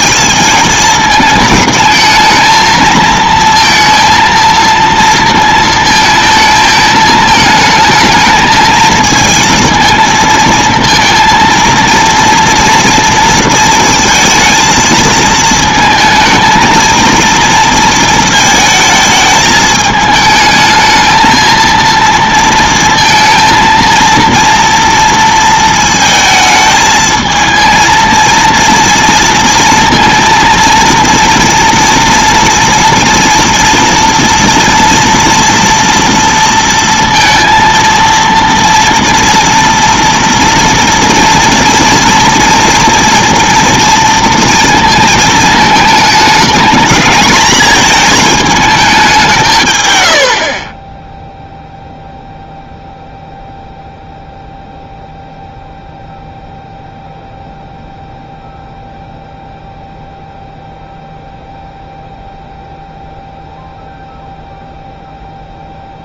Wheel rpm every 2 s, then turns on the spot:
220, 220, 230, 220, 220, 230, 230, 230, 220, 220, 220, 230, 230, 220, 230, 230, 230, 230, 230, 230, 230, 230, 230, 220, 220, 50, 0, 0, 0, 0, 0, 0, 0.
none